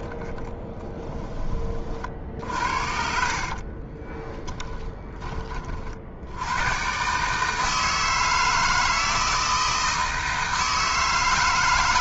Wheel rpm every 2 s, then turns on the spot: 10, 50, 10, 120, 160, 160.
0-4